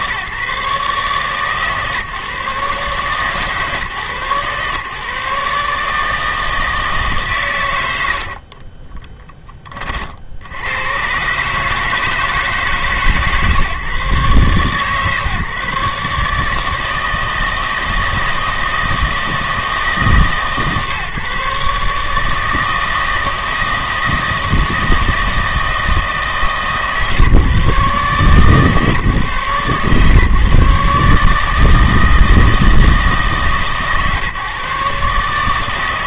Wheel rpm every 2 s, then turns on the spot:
140, 140, 130, 160, 40, 90, 150, 130, 160, 160, 140, 160, 160, 150, 140, 140, 160, 140.
8-10